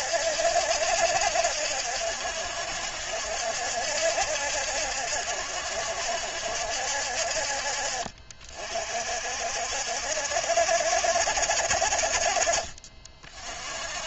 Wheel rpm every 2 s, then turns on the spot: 70, 70, 70, 60, 50, 60, 40.
none